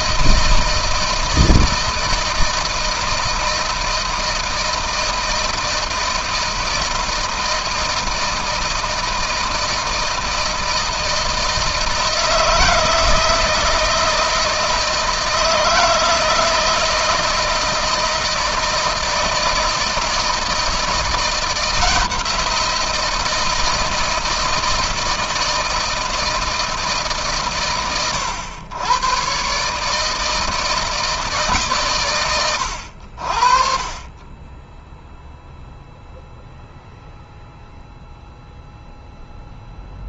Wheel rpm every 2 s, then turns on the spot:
160, 160, 160, 160, 160, 160, 160, 170, 160, 160, 160, 160, 160, 120, 120, 160, 90, 0, 0, 0.
none